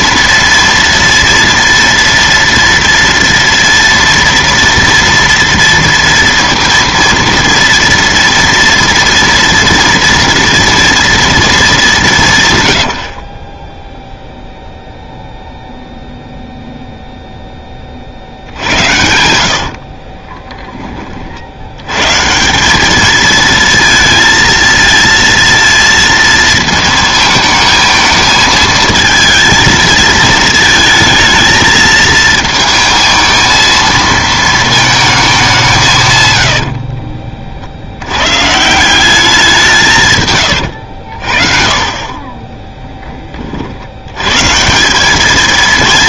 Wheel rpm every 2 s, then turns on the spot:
230, 230, 230, 230, 240, 230, 80, 0, 0, 80, 20, 190, 230, 220, 220, 220, 220, 220, 60, 170, 100, 10, 180.
36-38 40-44